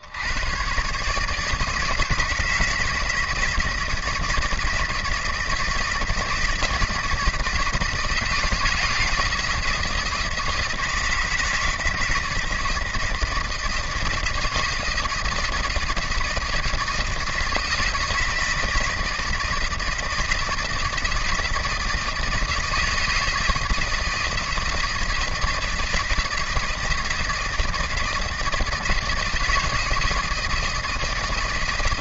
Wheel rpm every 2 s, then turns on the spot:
130, 160, 160, 160, 160, 170, 160, 160, 160, 160, 160, 160, 160, 160, 160, 160.
none